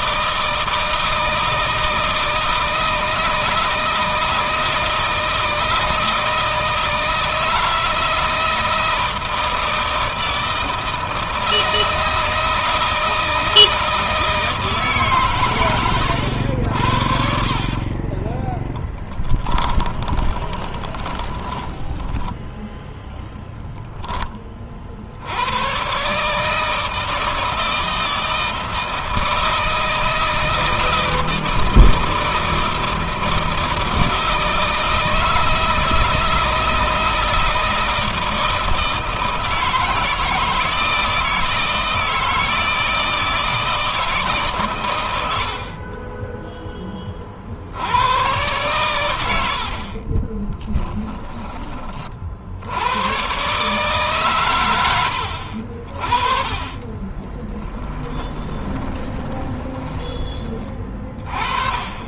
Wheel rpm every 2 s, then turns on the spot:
160, 160, 160, 160, 160, 160, 160, 130, 60, 10, 10, 0, 50, 160, 160, 160, 160, 160, 160, 160, 160, 160, 110, 20, 100, 10, 100, 80, 20, 20, 30.
18-22 50-52 56-60